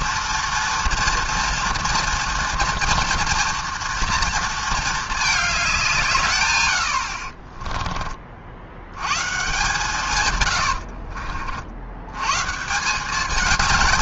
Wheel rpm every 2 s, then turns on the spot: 230, 230, 220, 90, 100, 70, 170.
10-12